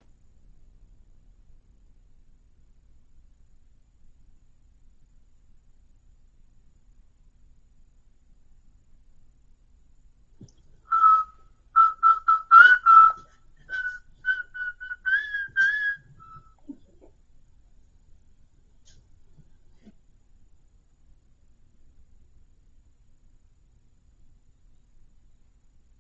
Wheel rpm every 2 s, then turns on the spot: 0, 0, 0, 0, 0, 0, 0, 0, 0, 0, 0, 0, 0.
none